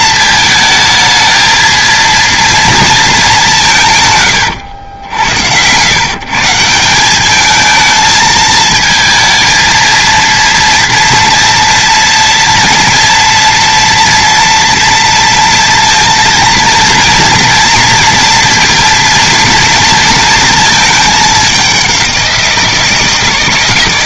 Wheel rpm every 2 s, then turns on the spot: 220, 230, 90, 170, 220, 230, 240, 230, 230, 230, 220, 170.
none